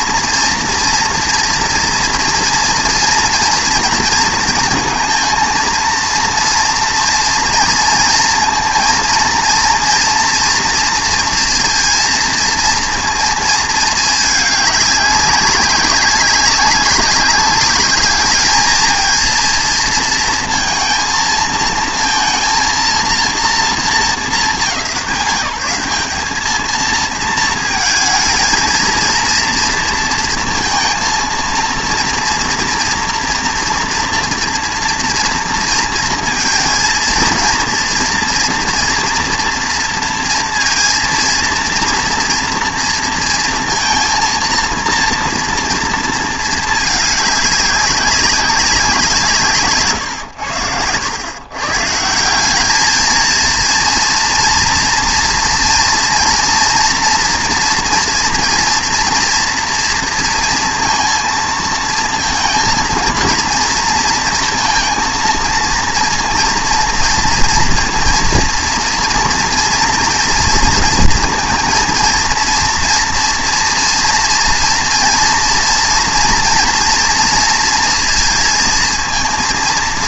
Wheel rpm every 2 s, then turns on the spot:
230, 230, 230, 230, 230, 230, 230, 200, 190, 220, 230, 230, 170, 220, 230, 230, 230, 230, 230, 230, 230, 230, 230, 210, 180, 100, 210, 230, 230, 230, 230, 230, 230, 230, 230, 230, 240, 230, 240, 230.
none